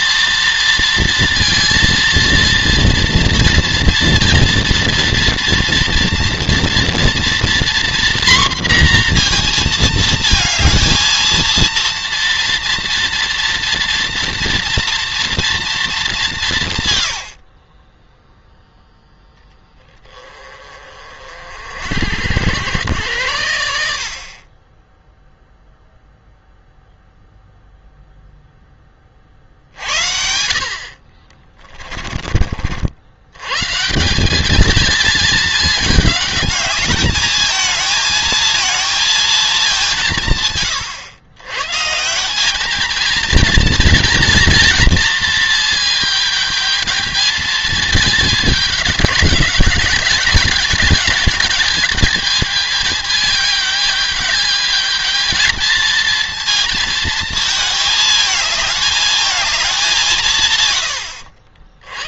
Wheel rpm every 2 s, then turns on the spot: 230, 230, 230, 230, 240, 230, 230, 230, 170, 0, 20, 90, 20, 0, 10, 50, 50, 220, 210, 230, 140, 200, 230, 210, 210, 210, 210, 210, 230, 220, 140.
none